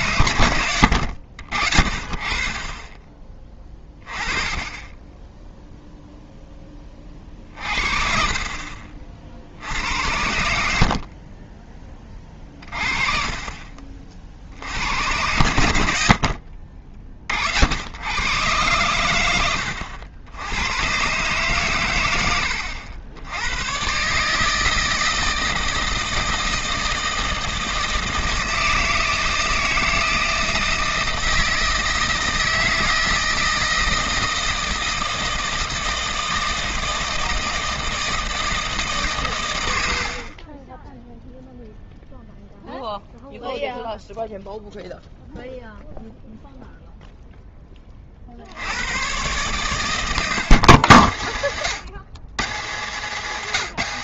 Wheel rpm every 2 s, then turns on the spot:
90, 30, 20, 10, 40, 70, 30, 70, 50, 120, 100, 80, 160, 160, 160, 160, 160, 160, 160, 160, 20, 0, 0, 0, 90, 130, 150.
none